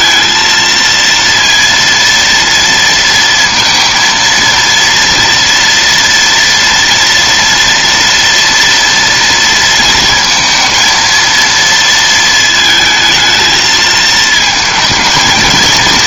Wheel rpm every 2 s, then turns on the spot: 230, 230, 230, 230, 230, 230, 220, 220.
none